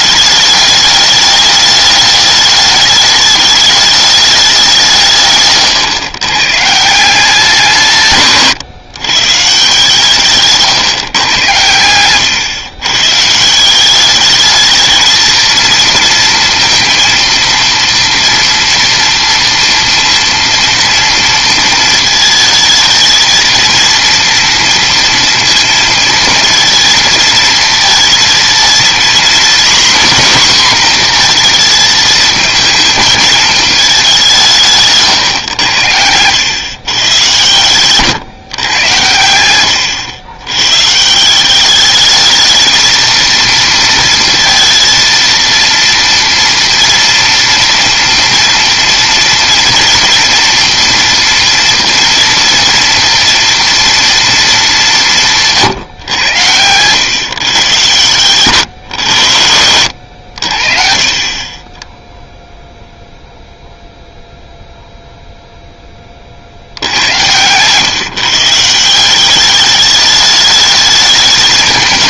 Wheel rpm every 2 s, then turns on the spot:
210, 210, 190, 130, 140, 150, 120, 210, 230, 240, 230, 220, 230, 230, 230, 250, 230, 180, 110, 130, 120, 220, 230, 230, 230, 240, 230, 210, 110, 110, 60, 0, 0, 60, 150, 210.
10-12